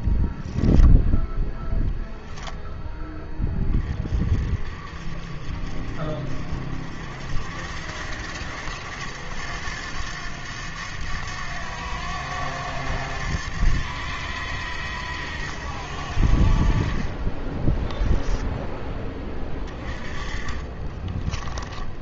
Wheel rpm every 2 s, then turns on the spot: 10, 10, 40, 60, 90, 90, 90, 80, 50, 10, 30.
2-4 20-22